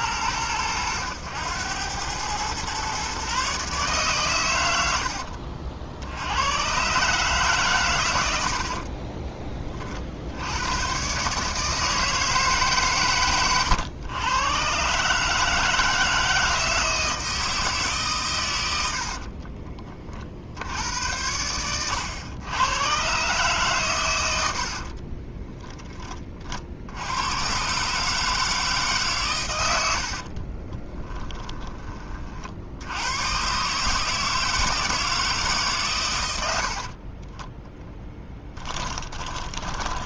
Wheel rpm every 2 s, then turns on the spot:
100, 120, 80, 130, 40, 120, 140, 140, 160, 80, 80, 120, 60, 70, 140, 20, 80, 160, 70, 20.
8-10 24-26 30-32 36-40